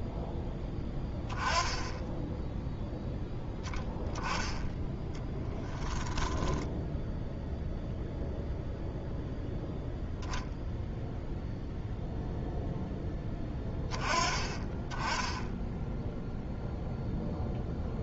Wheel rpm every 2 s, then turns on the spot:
10, 0, 10, 10, 0, 0, 10, 10, 0.
6-8